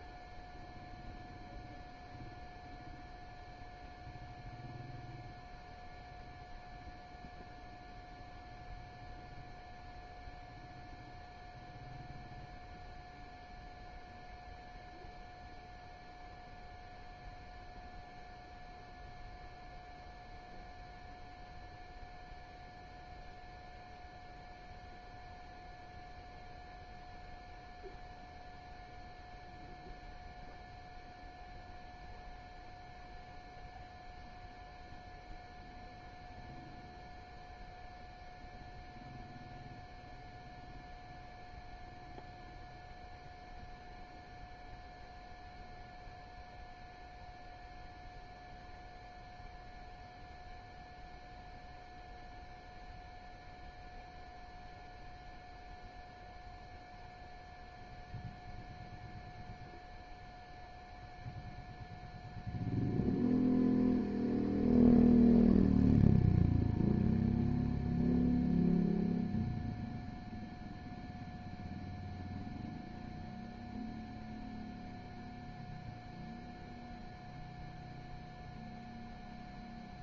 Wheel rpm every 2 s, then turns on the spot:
0, 0, 0, 0, 0, 0, 0, 0, 0, 0, 0, 0, 0, 0, 0, 0, 0, 0, 0, 0, 0, 0, 0, 0, 0, 0, 0, 0, 0, 0, 0, 0, 0, 0, 0, 0, 0, 0, 0, 0.
none